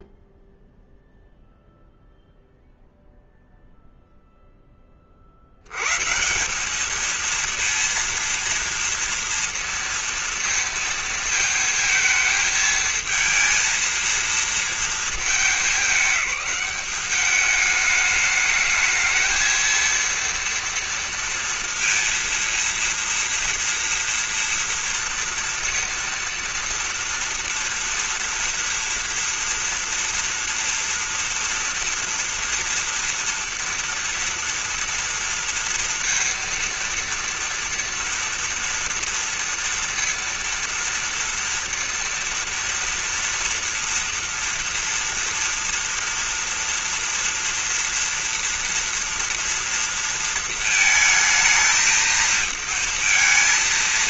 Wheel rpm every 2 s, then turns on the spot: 0, 0, 0, 150, 230, 230, 220, 230, 200, 210, 230, 230, 230, 230, 230, 230, 230, 230, 230, 230, 230, 230, 230, 230, 240, 230, 230.
none